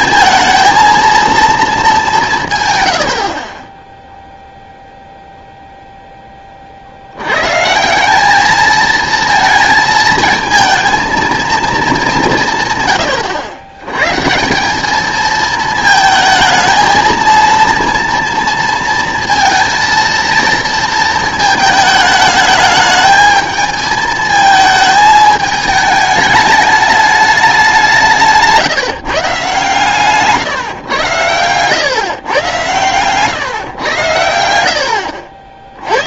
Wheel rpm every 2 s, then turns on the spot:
220, 130, 0, 40, 220, 220, 150, 180, 220, 230, 230, 210, 220, 210, 160, 130, 120, 80.
none